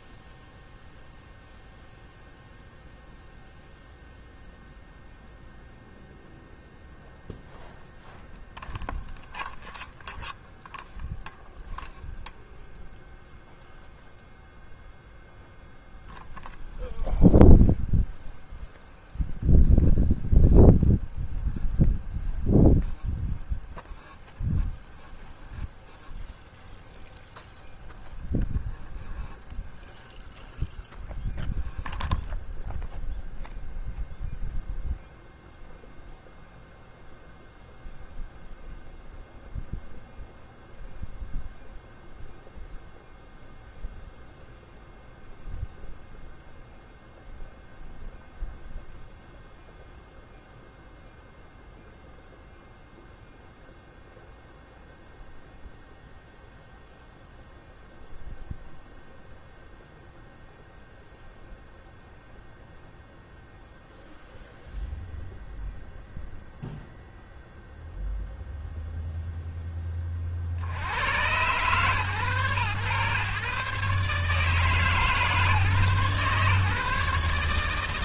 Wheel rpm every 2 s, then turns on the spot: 0, 0, 0, 0, 0, 0, 0, 0, 0, 0, 0, 0, 0, 0, 0, 0, 0, 0, 0, 0, 0, 0, 0, 0, 0, 0, 0, 0, 0, 0, 0, 0, 0, 0, 0, 80, 120, 150, 150.
none